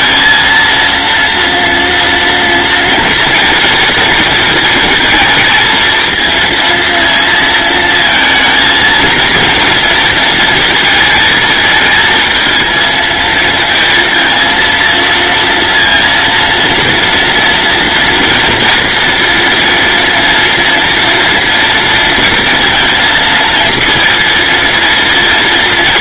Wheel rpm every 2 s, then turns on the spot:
230, 230, 230, 230, 230, 230, 220, 230, 230, 230, 230, 230, 230.
none